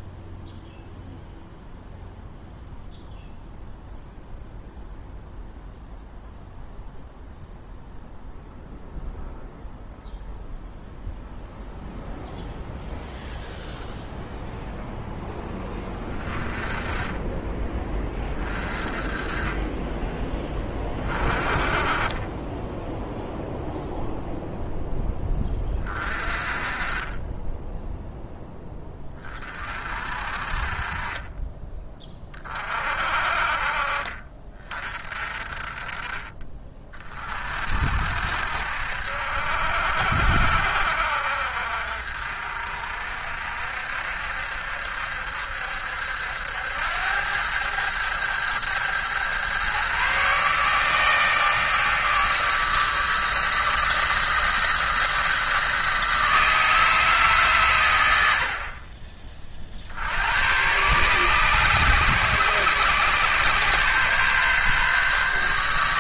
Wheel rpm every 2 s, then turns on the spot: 0, 0, 0, 0, 0, 0, 0, 0, 20, 30, 20, 10, 10, 30, 10, 30, 30, 40, 30, 60, 60, 60, 70, 80, 110, 150, 150, 160, 160, 40, 110, 130, 140.
none